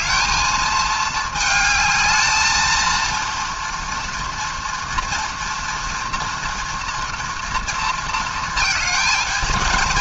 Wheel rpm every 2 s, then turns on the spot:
220, 220, 230, 230, 220.
none